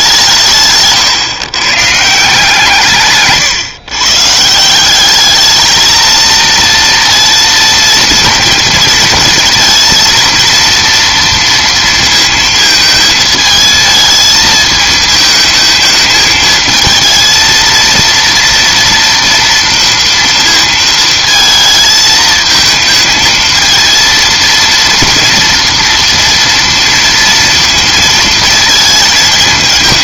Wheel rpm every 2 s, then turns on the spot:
150, 150, 180, 230, 230, 230, 220, 220, 220, 230, 230, 220, 230, 230, 220.
0-2